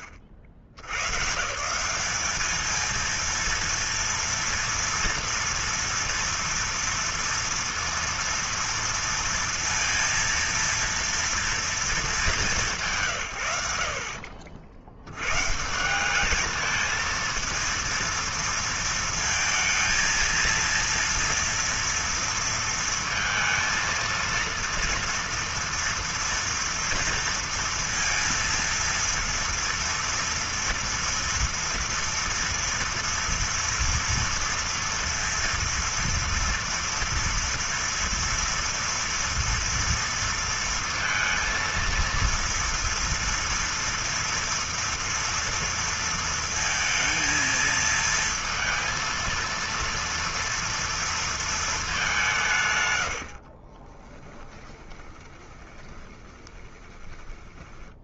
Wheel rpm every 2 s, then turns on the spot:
60, 230, 240, 230, 230, 230, 170, 80, 220, 230, 230, 230, 230, 230, 230, 230, 230, 230, 230, 230, 230, 230, 230, 230, 230, 230, 120, 20, 20.
54-58